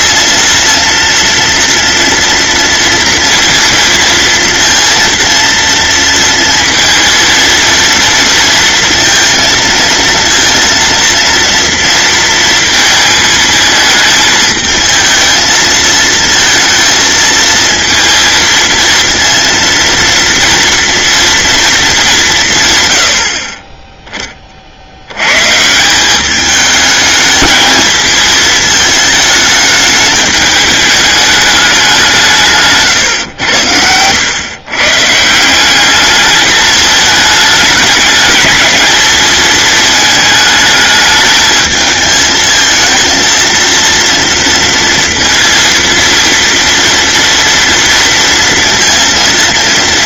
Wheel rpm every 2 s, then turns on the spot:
230, 230, 230, 230, 230, 230, 220, 220, 220, 230, 230, 90, 70, 210, 220, 210, 130, 140, 210, 220, 220, 230, 230, 230, 230.
none